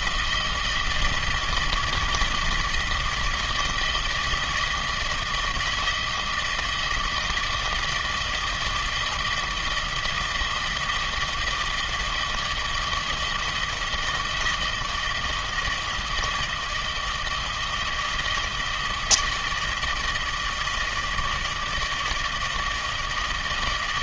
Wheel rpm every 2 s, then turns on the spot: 160, 160, 170, 160, 160, 160, 160, 160, 160, 160, 160, 160.
none